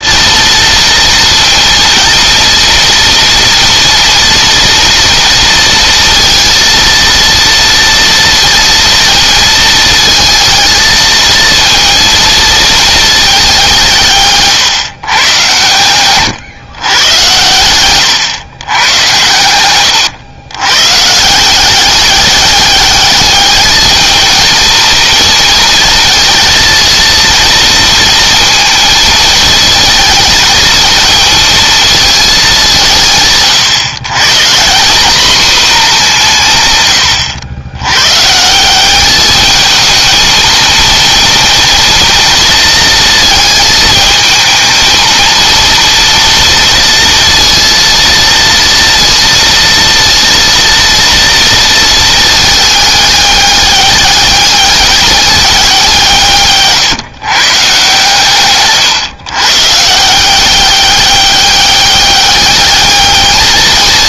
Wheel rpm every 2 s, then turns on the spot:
230, 230, 230, 230, 230, 220, 220, 150, 120, 120, 100, 200, 230, 230, 230, 220, 210, 140, 170, 140, 220, 230, 220, 230, 230, 230, 220, 200, 160, 140, 190, 210.
14-16 58-60